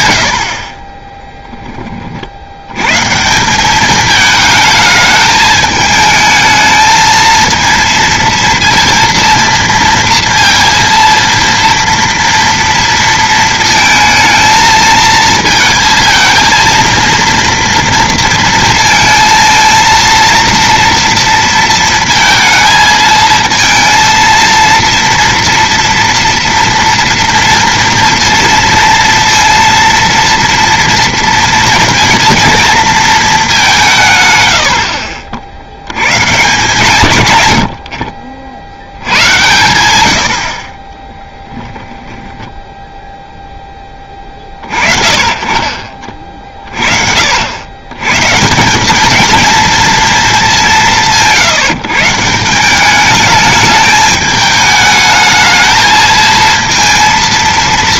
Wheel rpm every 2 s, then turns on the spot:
40, 90, 220, 220, 230, 230, 230, 230, 230, 230, 230, 220, 230, 230, 230, 230, 230, 90, 150, 60, 50, 10, 30, 50, 180, 190, 180, 210, 230.
none